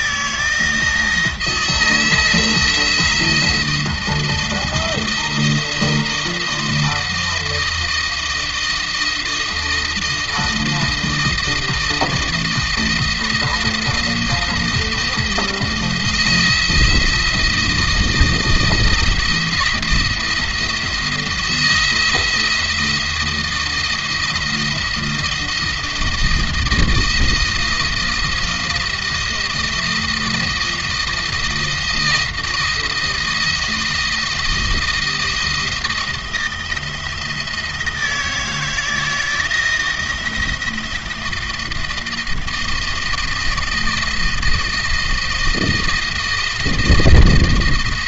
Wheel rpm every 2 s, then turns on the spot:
160, 170, 170, 170, 170, 160, 170, 170, 170, 170, 170, 160, 160, 160, 160, 170, 170, 170, 160, 160, 170, 160, 160, 160.
none